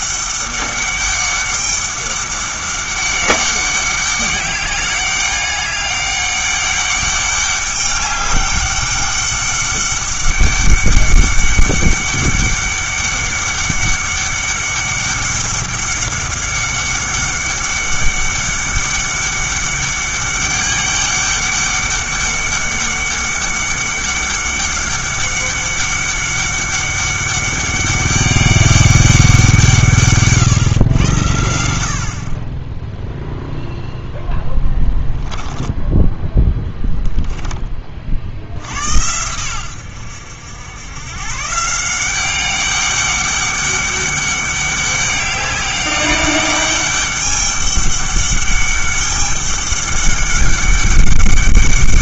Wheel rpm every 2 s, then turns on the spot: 200, 200, 200, 200, 200, 200, 200, 200, 190, 200, 200, 200, 200, 200, 200, 120, 10, 10, 10, 80, 100, 200, 200, 200, 200, 200.
34-38